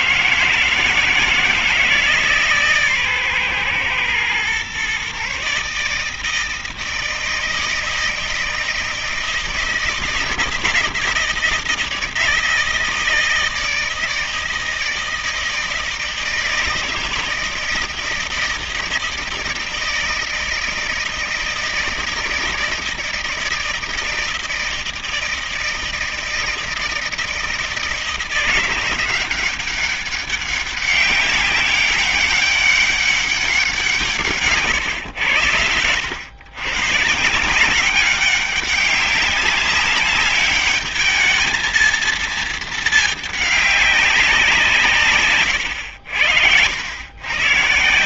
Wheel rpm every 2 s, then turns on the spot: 160, 150, 120, 160, 160, 160, 160, 160, 160, 160, 160, 160, 160, 160, 170, 190, 190, 160, 100, 190, 200, 220, 180, 90.
none